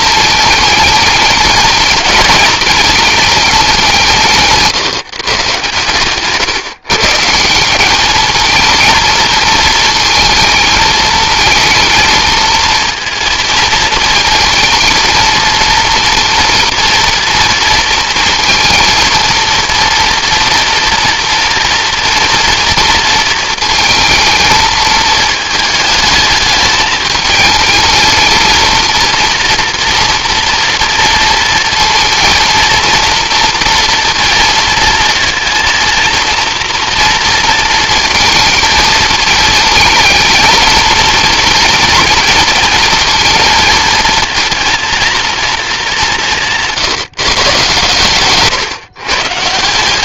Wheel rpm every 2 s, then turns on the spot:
220, 220, 150, 140, 220, 220, 230, 230, 230, 230, 230, 230, 220, 210, 230, 230, 230, 230, 230, 230, 230, 230, 220, 160, 120.
none